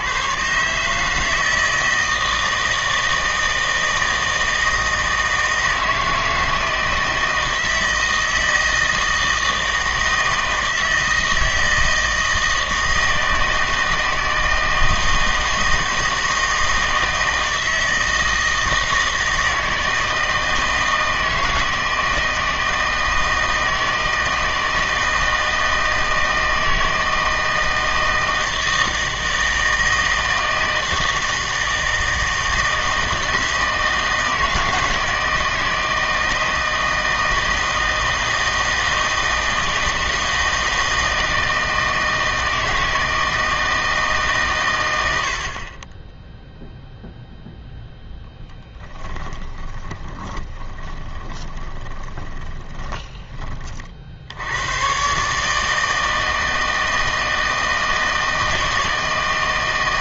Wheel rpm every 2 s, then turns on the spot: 140, 160, 160, 160, 160, 160, 160, 160, 160, 160, 160, 160, 160, 160, 160, 160, 160, 160, 160, 160, 160, 160, 130, 0, 10, 20, 30, 90, 160, 160.
48-54